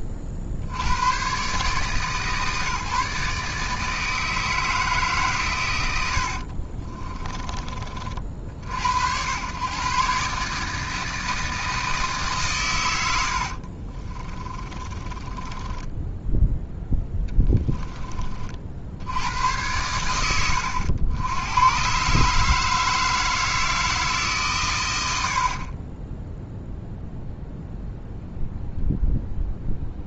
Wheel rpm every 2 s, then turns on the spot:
90, 140, 150, 30, 70, 160, 90, 30, 10, 40, 90, 160, 100, 0, 0.
6-8 14-16